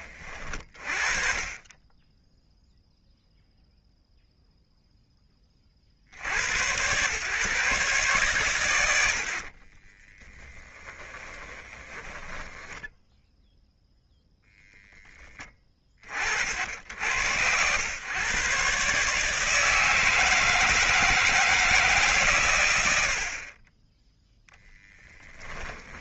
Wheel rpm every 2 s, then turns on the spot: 30, 10, 0, 90, 100, 10, 10, 0, 60, 130, 160, 120, 10.
2-4 10-14